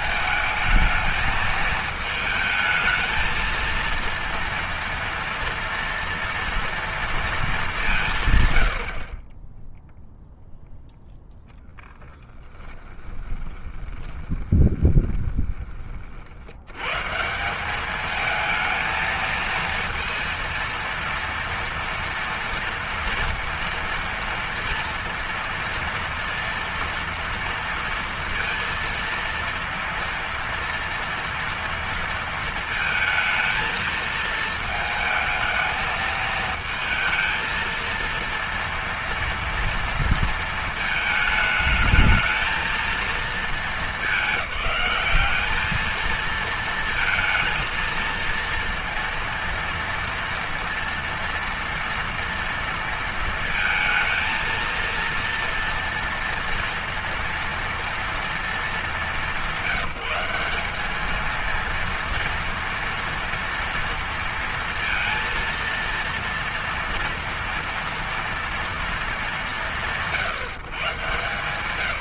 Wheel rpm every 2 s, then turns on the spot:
220, 230, 230, 230, 30, 0, 20, 20, 130, 220, 230, 240, 230, 230, 230, 230, 220, 220, 220, 230, 230, 220, 210, 230, 230, 240, 230, 230, 230, 220, 200, 230, 230, 230, 230, 140.
12-16